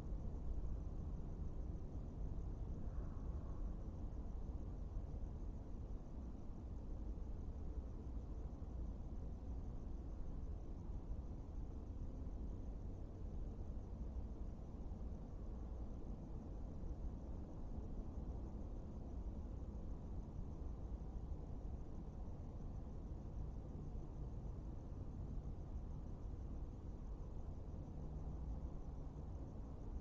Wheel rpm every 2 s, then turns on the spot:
0, 0, 0, 0, 0, 0, 0, 0, 0, 0, 0, 0, 0, 0, 0.
none